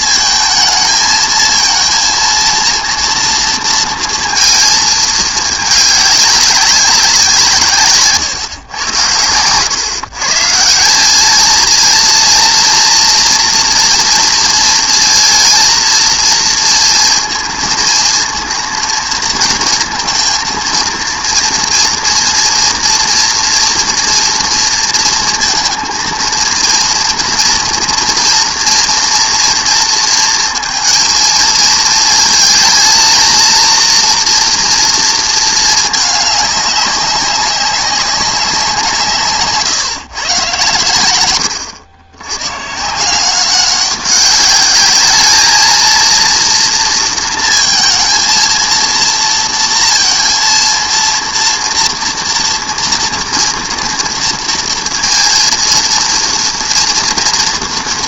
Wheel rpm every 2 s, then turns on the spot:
220, 230, 220, 200, 120, 170, 240, 230, 230, 230, 230, 230, 230, 240, 230, 220, 230, 230, 200, 180, 120, 140, 200, 230, 230, 230, 230, 230, 230.
none